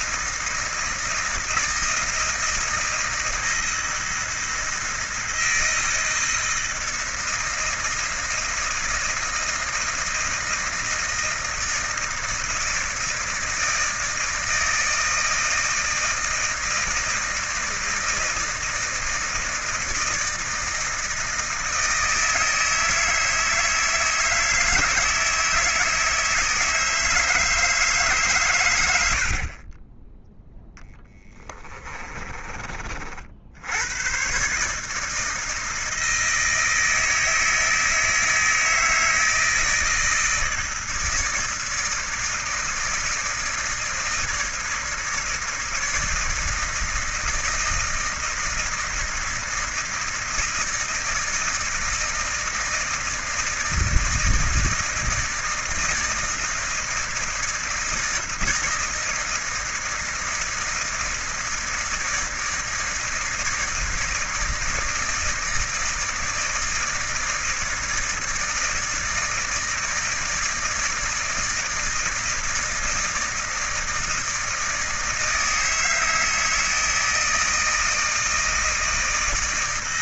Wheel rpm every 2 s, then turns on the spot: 160, 160, 160, 160, 160, 160, 160, 160, 160, 160, 160, 160, 160, 160, 90, 0, 30, 150, 160, 160, 160, 160, 160, 160, 160, 160, 160, 160, 160, 160, 160, 160, 150, 160, 160, 160, 160, 160, 160, 160.
none